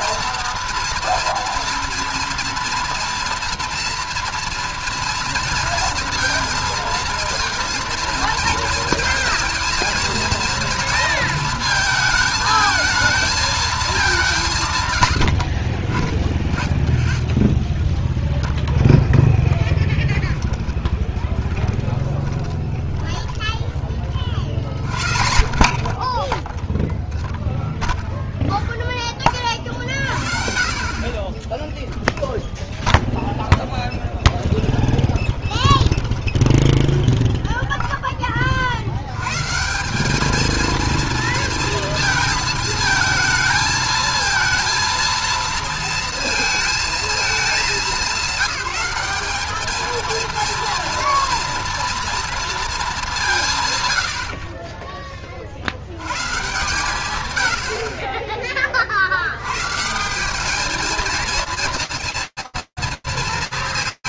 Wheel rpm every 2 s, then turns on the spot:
230, 230, 240, 230, 230, 230, 220, 170, 30, 0, 20, 20, 40, 10, 0, 40, 0, 0, 20, 40, 220, 230, 230, 230, 200, 230, 230, 40, 140, 40, 200, 230.
20-24 36-38